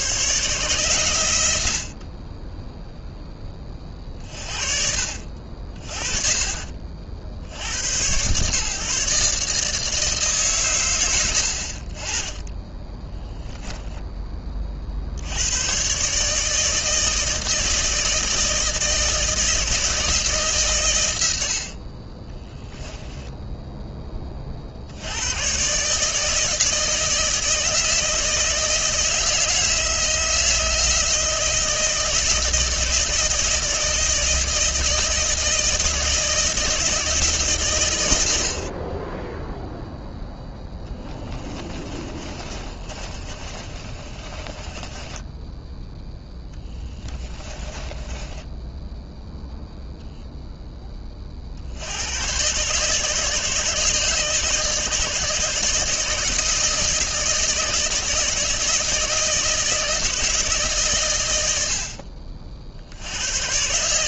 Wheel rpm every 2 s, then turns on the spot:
130, 10, 50, 50, 150, 110, 20, 70, 160, 160, 120, 10, 70, 160, 160, 160, 160, 160, 160, 20, 10, 30, 20, 20, 0, 10, 140, 150, 160, 160, 130, 80.
12-14 40-48